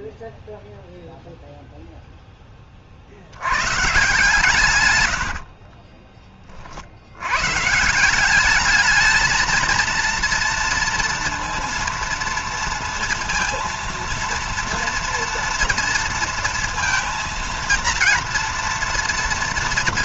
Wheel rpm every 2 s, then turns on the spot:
0, 30, 110, 50, 210, 230, 230, 240, 230, 230.
4-6